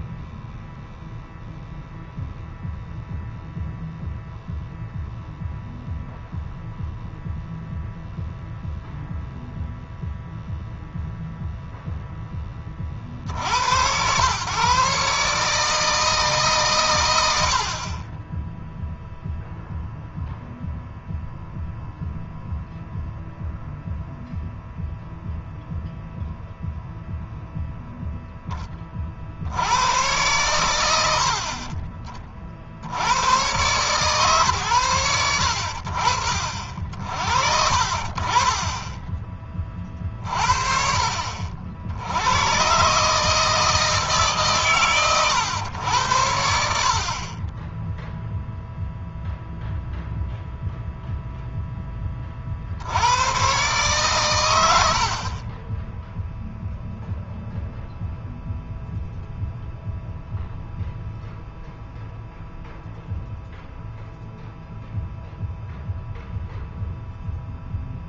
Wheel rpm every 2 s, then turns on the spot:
0, 0, 0, 0, 0, 0, 40, 130, 110, 0, 0, 0, 0, 0, 30, 100, 70, 110, 50, 20, 50, 110, 140, 70, 0, 0, 70, 80, 0, 0, 0, 0, 0, 0.
none